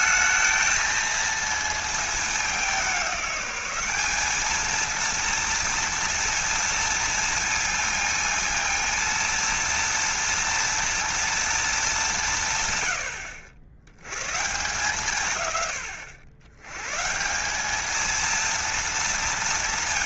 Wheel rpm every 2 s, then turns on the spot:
220, 200, 220, 230, 230, 230, 130, 130, 100, 230.
none